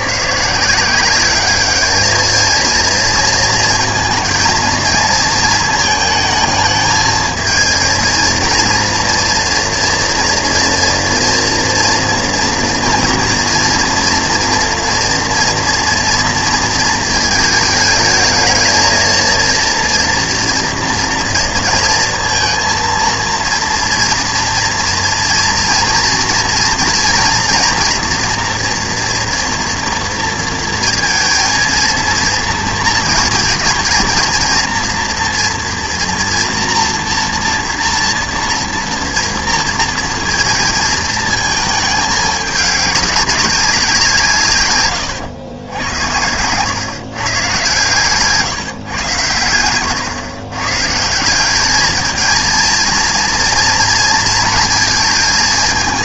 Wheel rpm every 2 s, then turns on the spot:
140, 230, 230, 220, 230, 230, 230, 230, 230, 220, 230, 230, 230, 230, 240, 230, 230, 230, 230, 230, 230, 210, 130, 110, 150, 130, 220, 230.
none